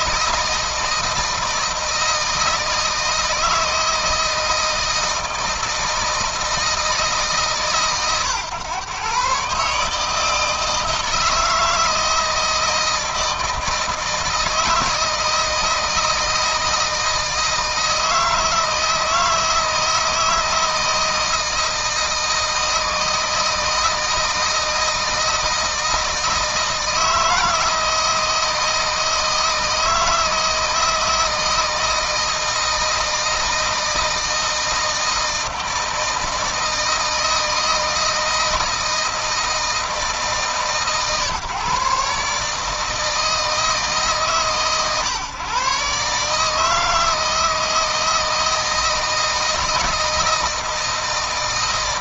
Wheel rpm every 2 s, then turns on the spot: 160, 160, 160, 160, 120, 160, 160, 160, 160, 160, 160, 160, 160, 160, 160, 160, 160, 160, 160, 160, 150, 150, 140, 160, 160, 160.
none